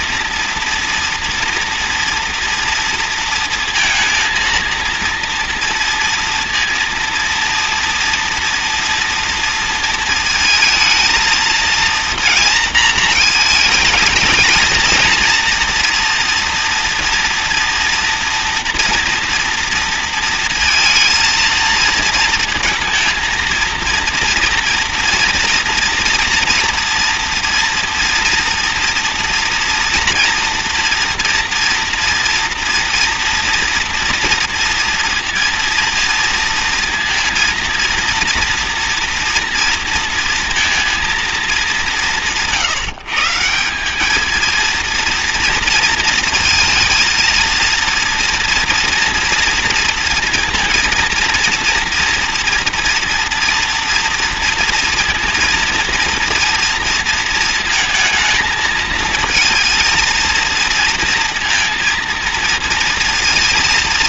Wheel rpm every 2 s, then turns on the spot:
230, 230, 230, 230, 230, 220, 230, 220, 230, 230, 230, 230, 230, 240, 230, 230, 230, 230, 230, 230, 230, 170, 220, 230, 230, 230, 230, 230, 230, 230, 230, 230.
none